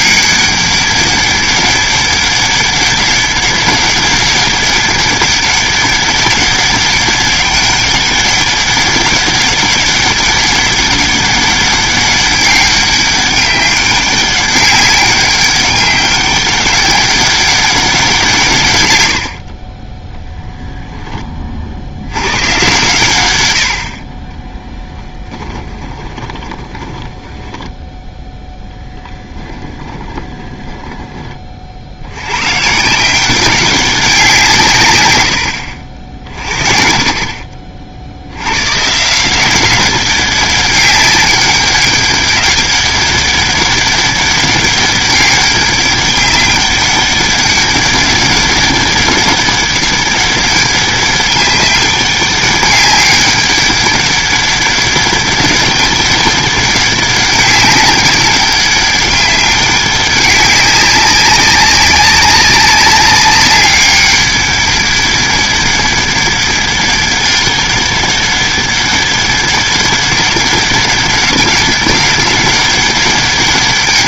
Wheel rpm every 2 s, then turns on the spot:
200, 200, 200, 200, 190, 200, 200, 190, 200, 110, 10, 130, 10, 10, 10, 20, 150, 130, 50, 130, 200, 200, 200, 200, 200, 200, 200, 200, 200, 200, 200, 190, 200, 200, 200, 200, 200.
24-32